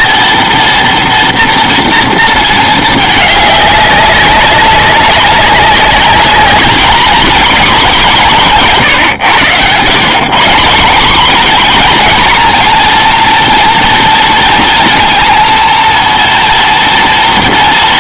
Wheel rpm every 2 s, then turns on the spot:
230, 220, 190, 220, 190, 170, 230, 230, 230.
none